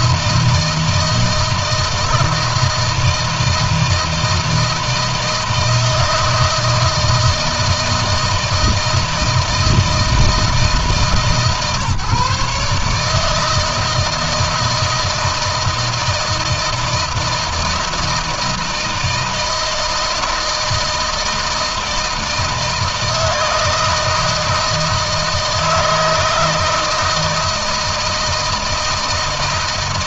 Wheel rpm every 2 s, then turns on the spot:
160, 160, 160, 160, 160, 150, 150, 160, 160, 160, 160, 160, 160, 160, 160.
none